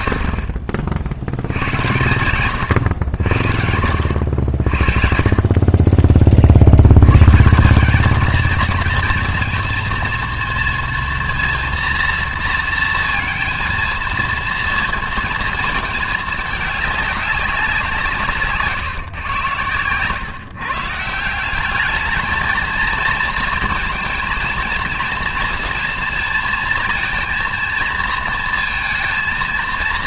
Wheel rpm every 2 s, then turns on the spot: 50, 110, 60, 70, 230, 230, 230, 230, 210, 140, 150, 220, 220, 230, 230.
0-2